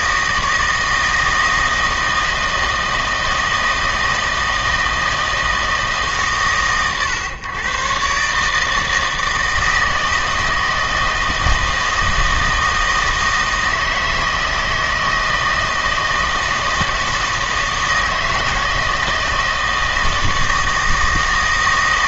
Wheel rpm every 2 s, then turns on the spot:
160, 160, 160, 130, 160, 160, 160, 160, 160, 160, 160.
none